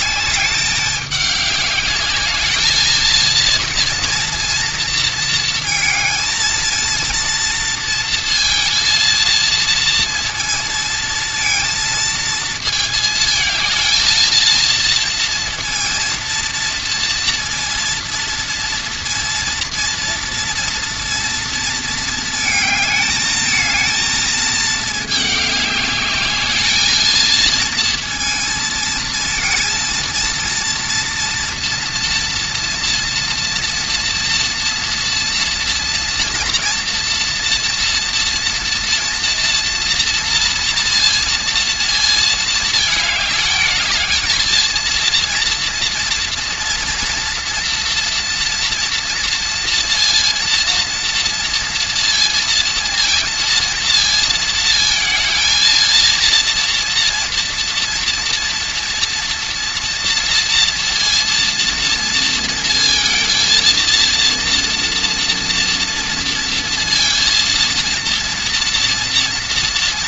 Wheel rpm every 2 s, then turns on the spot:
210, 220, 230, 230, 230, 230, 220, 230, 230, 230, 230, 220, 220, 210, 230, 230, 230, 230, 230, 240, 230, 220, 220, 230, 230, 230, 230, 220, 230, 230, 230, 230, 240, 230, 240.
none